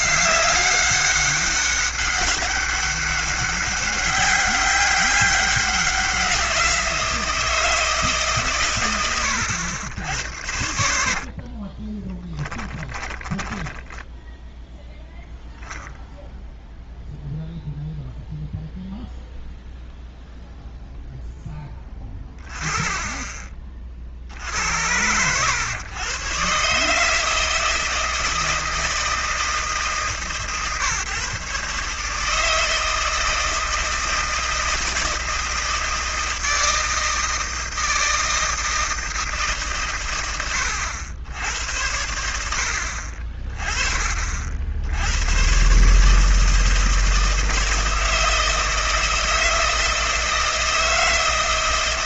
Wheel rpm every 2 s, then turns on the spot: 200, 200, 200, 170, 130, 80, 10, 0, 0, 0, 0, 30, 70, 130, 160, 130, 160, 160, 160, 160, 90, 70, 60, 160, 160, 160.
10-14